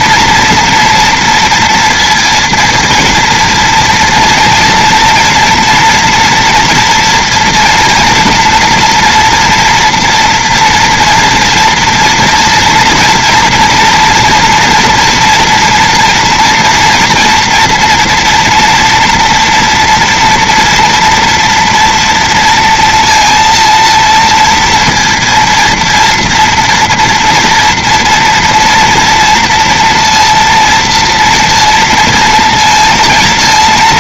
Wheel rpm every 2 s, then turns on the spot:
230, 230, 230, 240, 240, 230, 230, 230, 230, 230, 230, 230, 230, 230, 230, 230, 230.
none